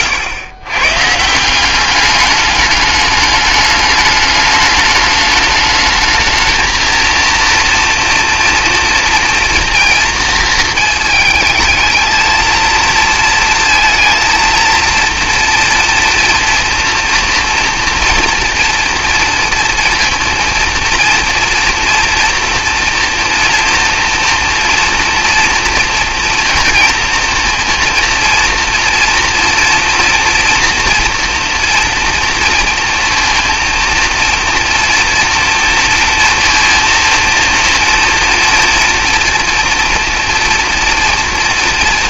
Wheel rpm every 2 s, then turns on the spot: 120, 210, 210, 230, 230, 230, 230, 230, 230, 230, 230, 230, 230, 230, 230, 230, 230, 230, 230, 230, 240.
none